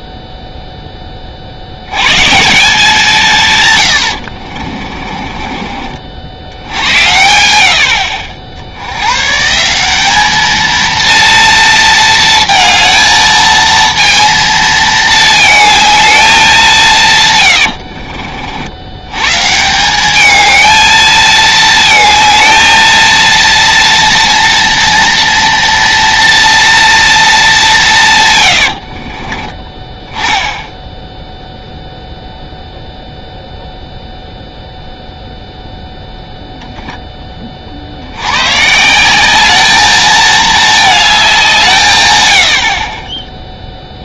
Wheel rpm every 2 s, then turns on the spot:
0, 150, 70, 70, 70, 210, 230, 230, 190, 70, 210, 230, 230, 230, 110, 10, 0, 0, 0, 120, 220, 70.
4-6 28-30